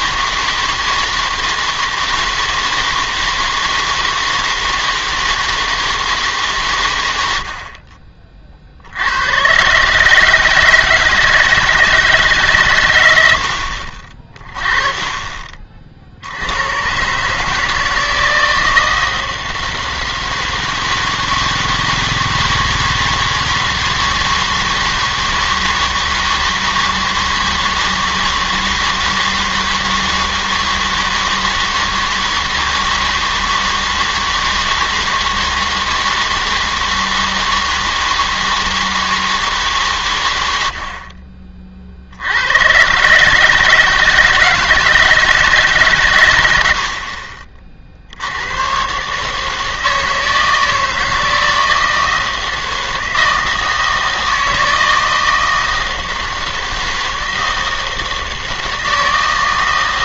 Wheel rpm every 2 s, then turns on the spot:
160, 160, 160, 140, 50, 160, 130, 30, 90, 160, 160, 160, 160, 160, 160, 160, 160, 160, 160, 160, 80, 90, 160, 80, 110, 160, 160, 160, 160, 160.
none